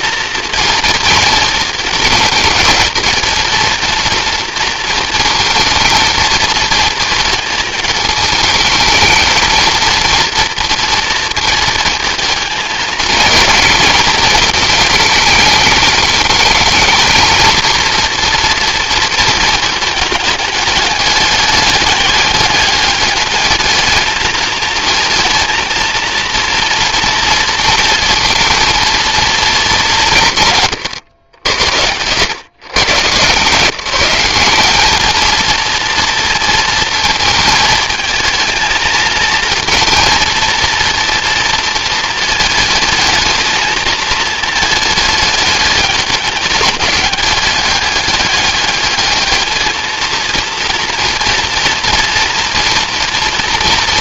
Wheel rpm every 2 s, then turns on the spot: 230, 230, 230, 230, 220, 230, 220, 220, 220, 230, 210, 200, 220, 230, 230, 150, 120, 200, 230, 220, 230, 220, 220, 210, 200, 230, 230.
none